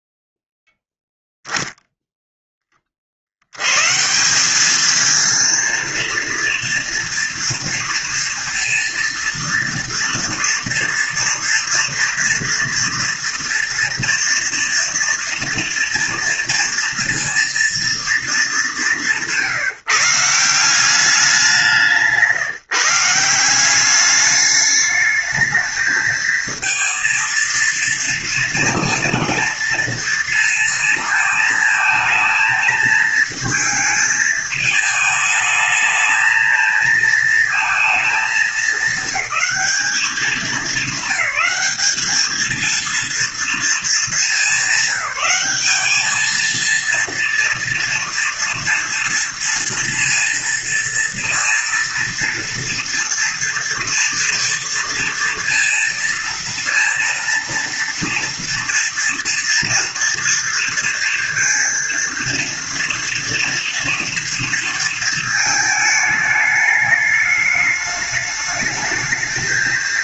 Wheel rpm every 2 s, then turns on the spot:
0, 20, 210, 230, 230, 230, 230, 230, 230, 200, 180, 160, 210, 230, 230, 230, 220, 220, 220, 220, 200, 220, 210, 230, 230, 230, 230, 230, 230, 230, 230, 230, 230, 210, 210.
none